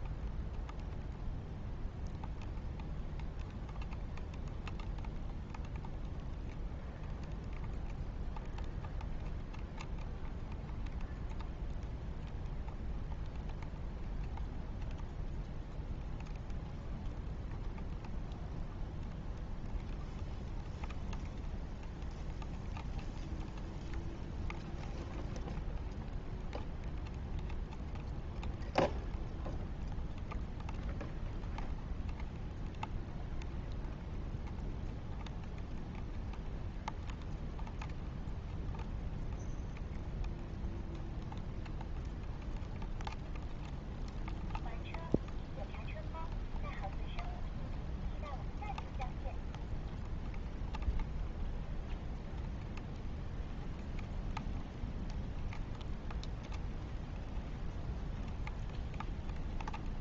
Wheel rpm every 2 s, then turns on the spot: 0, 0, 0, 0, 0, 0, 0, 0, 0, 0, 0, 0, 0, 0, 0, 0, 0, 0, 0, 0, 0, 0, 0, 0, 0, 0, 0, 0, 0, 0.
none